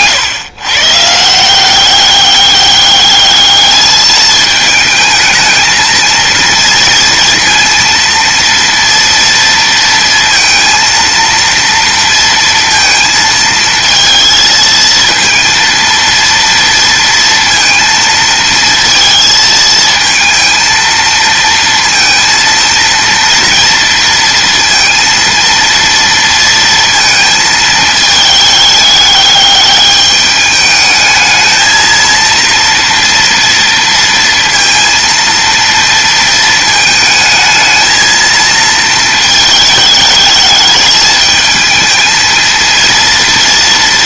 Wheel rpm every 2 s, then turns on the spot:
140, 200, 220, 230, 230, 230, 230, 230, 230, 230, 230, 230, 230, 230, 210, 210, 230, 230, 220, 230, 210, 230.
none